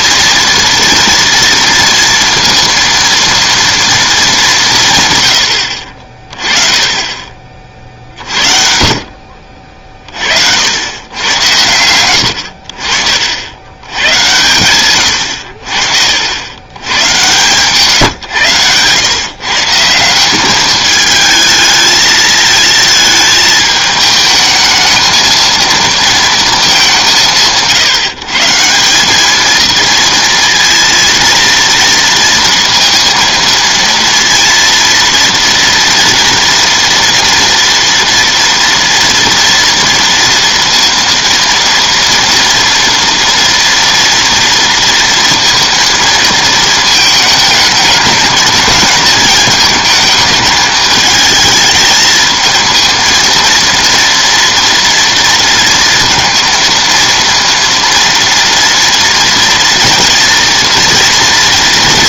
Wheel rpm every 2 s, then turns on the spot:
240, 230, 150, 20, 50, 90, 60, 110, 110, 110, 210, 220, 220, 210, 170, 230, 230, 230, 230, 230, 230, 230, 230, 220, 220, 220, 220, 230, 230, 240, 230.
12-14